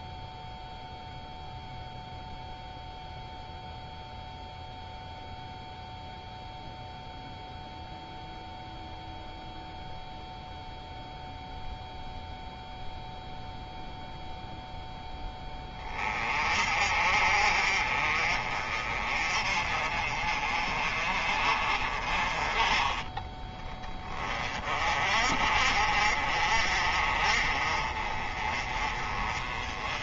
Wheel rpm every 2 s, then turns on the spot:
0, 0, 0, 0, 0, 0, 0, 10, 40, 30, 40, 20, 40, 40, 30.
none